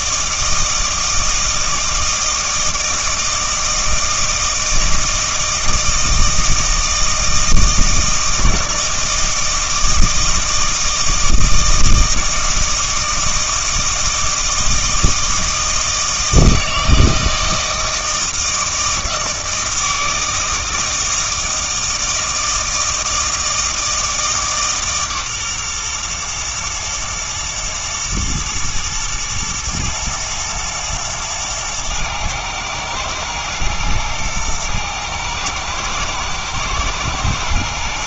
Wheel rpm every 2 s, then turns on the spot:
160, 160, 160, 160, 170, 160, 160, 160, 160, 160, 160, 160, 150, 120, 110, 110, 110, 110, 110.
none